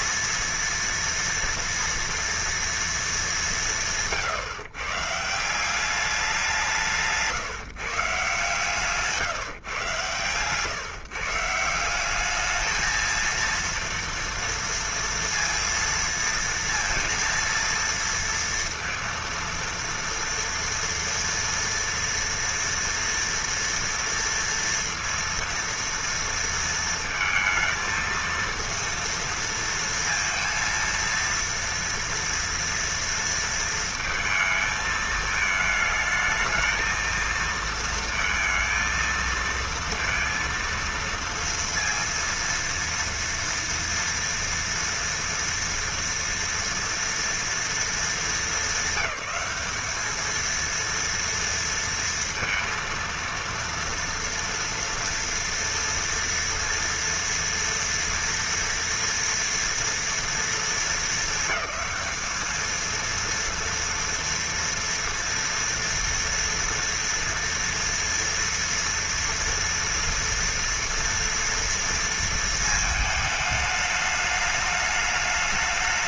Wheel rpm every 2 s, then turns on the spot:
230, 230, 140, 180, 150, 140, 220, 230, 230, 230, 240, 230, 230, 230, 230, 230, 230, 220, 220, 230, 230, 230, 230, 230, 210, 230, 230, 230, 230, 230, 230, 220, 230, 230, 230, 240, 220, 210.
none